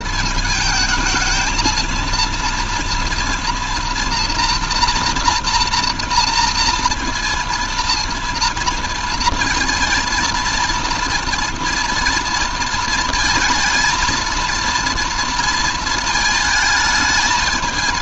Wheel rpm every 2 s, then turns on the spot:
210, 230, 230, 230, 230, 230, 230, 230, 220.
none